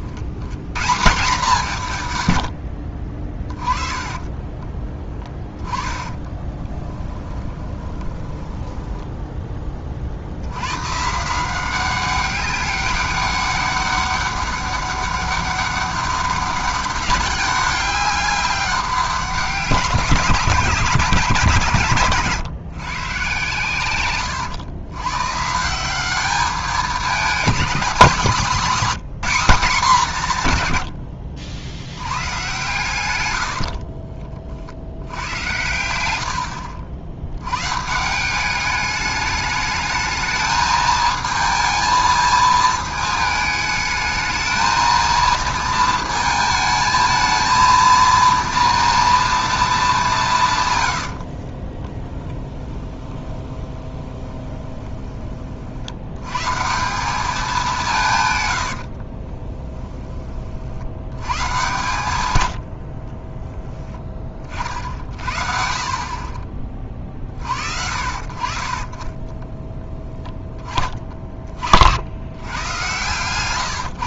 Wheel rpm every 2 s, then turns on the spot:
120, 70, 20, 10, 10, 100, 200, 200, 200, 190, 160, 130, 100, 200, 210, 120, 130, 60, 70, 200, 220, 220, 220, 220, 230, 120, 10, 20, 160, 100, 50, 80, 40, 30, 40, 20, 110.
6-10 36-38 52-56 58-60 66-68